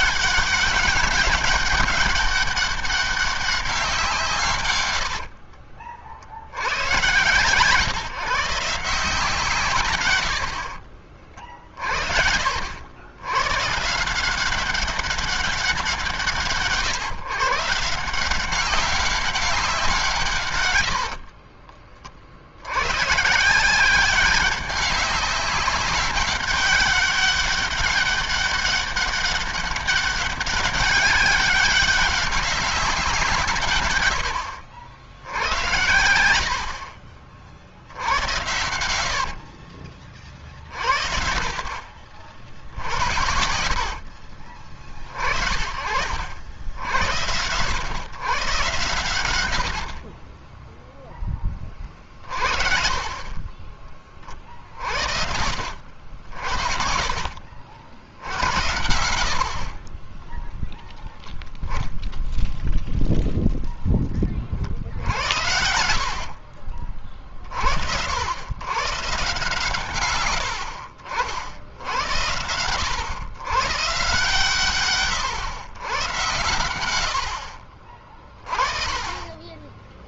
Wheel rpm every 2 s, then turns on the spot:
200, 200, 80, 110, 160, 40, 90, 190, 130, 190, 60, 120, 200, 200, 200, 200, 180, 80, 50, 80, 50, 60, 30, 90, 120, 10, 40, 60, 40, 70, 0, 0, 60, 40, 130, 70, 100, 130, 60, 30.
4-6 10-12 20-22 36-38 58-60